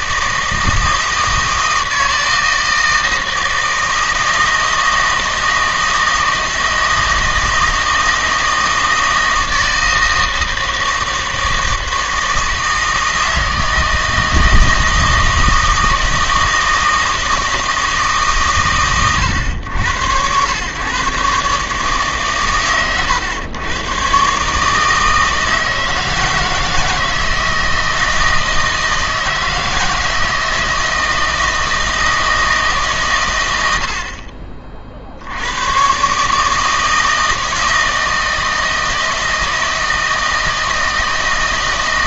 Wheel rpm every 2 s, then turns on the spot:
160, 160, 160, 160, 160, 160, 160, 160, 160, 120, 110, 120, 150, 160, 160, 160, 150, 50, 160, 160, 160.
none